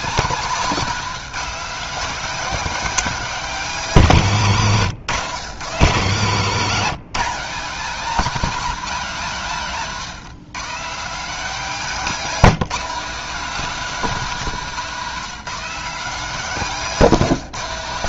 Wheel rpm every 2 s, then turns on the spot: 230, 270, 180, 210, 230, 220, 220, 220, 220.
none